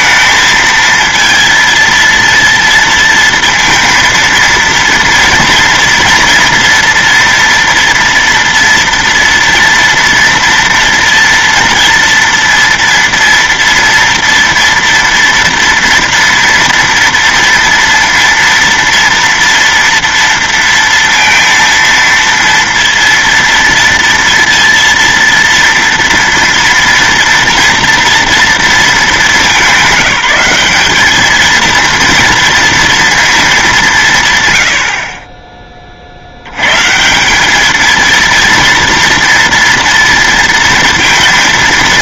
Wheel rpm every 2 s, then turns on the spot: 230, 230, 230, 230, 240, 230, 230, 230, 230, 230, 230, 230, 230, 230, 220, 200, 230, 90, 130, 230, 230.
none